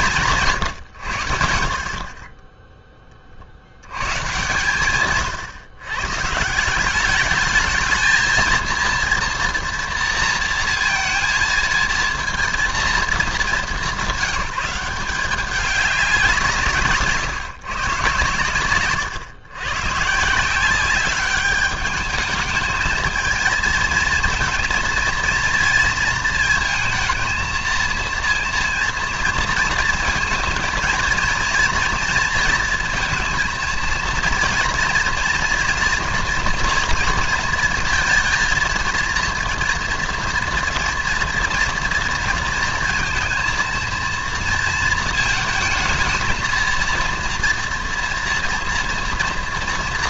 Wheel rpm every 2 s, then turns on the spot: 130, 10, 130, 170, 230, 230, 230, 190, 160, 120, 180, 220, 230, 230, 230, 220, 230, 230, 230, 230, 230, 230, 230, 230, 230.
18-20